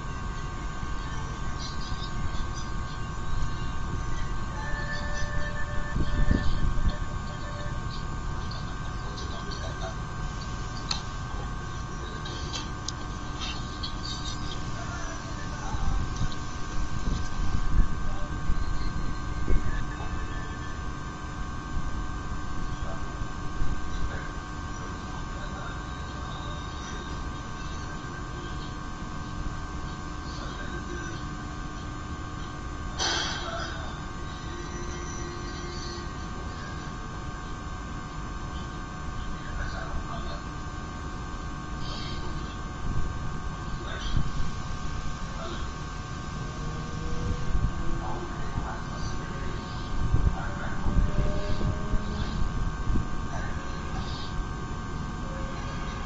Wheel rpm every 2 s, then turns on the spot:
0, 0, 0, 0, 0, 0, 0, 0, 0, 0, 0, 0, 0, 0, 0, 0, 0, 0, 0, 0, 0, 0, 0, 0, 0, 0, 0, 0.
none